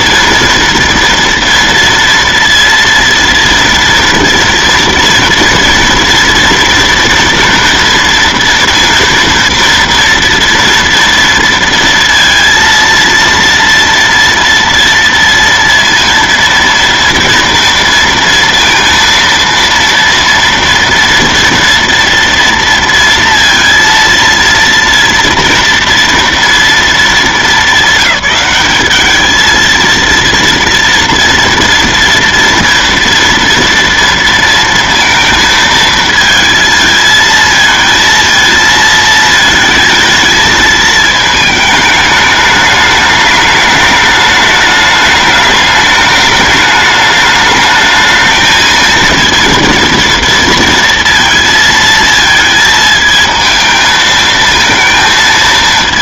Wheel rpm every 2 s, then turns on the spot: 230, 230, 230, 230, 230, 230, 230, 230, 230, 230, 230, 230, 230, 220, 200, 230, 230, 230, 220, 220, 220, 210, 210, 210, 230, 230, 220, 220.
none